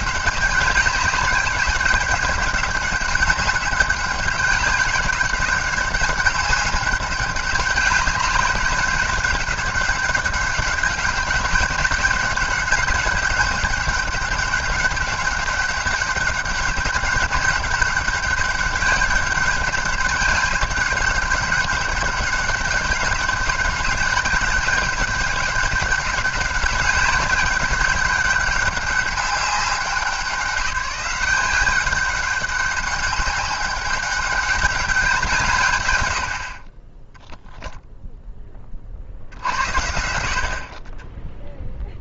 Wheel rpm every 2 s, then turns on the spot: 190, 200, 190, 200, 200, 200, 200, 200, 200, 200, 200, 200, 200, 200, 200, 190, 200, 190, 20, 40, 40.
none